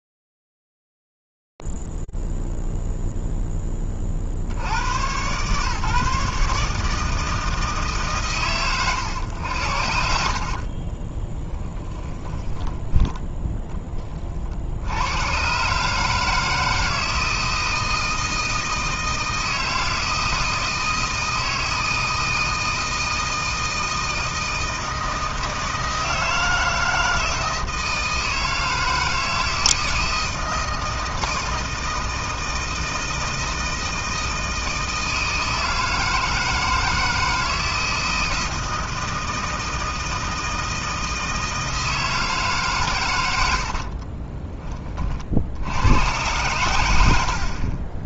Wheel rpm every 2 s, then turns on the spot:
0, 0, 40, 140, 120, 50, 10, 70, 160, 160, 160, 160, 160, 160, 160, 160, 160, 160, 160, 160, 160, 130, 30, 100.
10-14